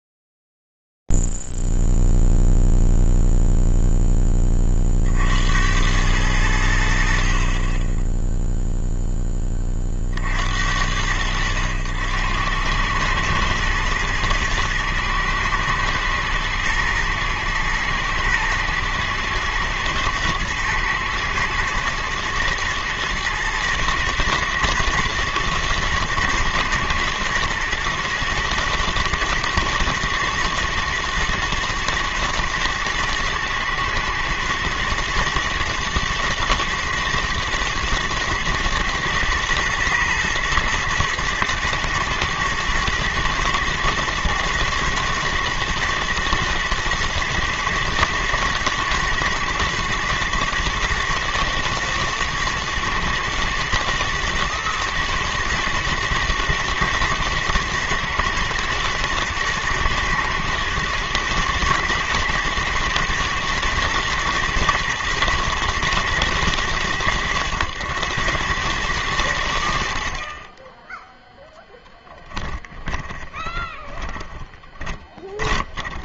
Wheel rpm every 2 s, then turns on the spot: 0, 0, 20, 90, 0, 70, 100, 110, 120, 110, 110, 120, 110, 110, 120, 110, 110, 120, 120, 120, 110, 110, 110, 120, 110, 110, 110, 110, 120, 120, 110, 110, 110, 100, 30, 20, 20, 20.
70-76